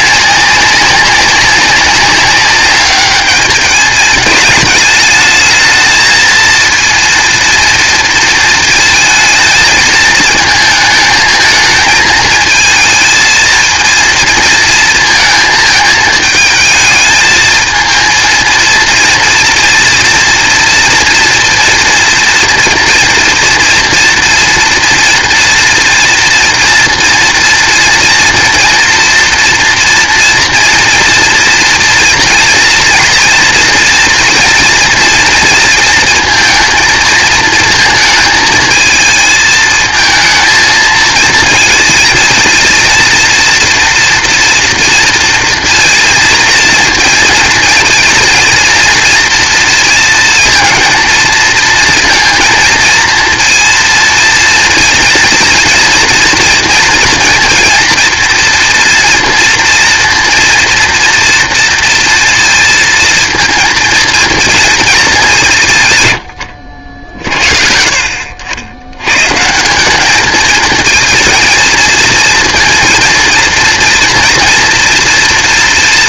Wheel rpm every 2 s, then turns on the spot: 200, 200, 220, 230, 220, 230, 230, 230, 220, 230, 230, 230, 230, 230, 230, 230, 240, 230, 220, 220, 230, 230, 230, 230, 230, 230, 230, 230, 230, 230, 230, 230, 220, 80, 100, 230, 230, 230.
none